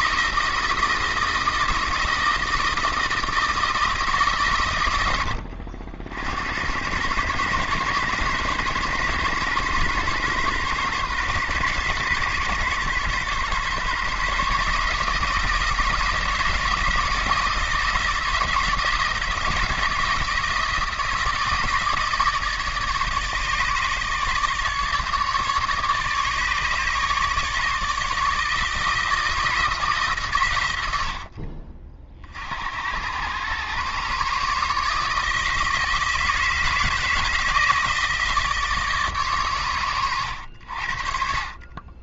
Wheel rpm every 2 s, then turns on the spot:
170, 160, 110, 90, 130, 130, 130, 150, 160, 160, 160, 150, 150, 150, 160, 90, 70, 150, 160, 150, 70.
none